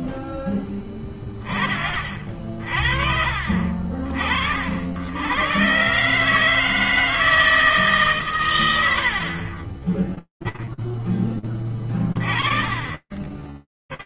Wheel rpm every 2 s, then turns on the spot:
20, 50, 100, 160, 30, 10, 20.
none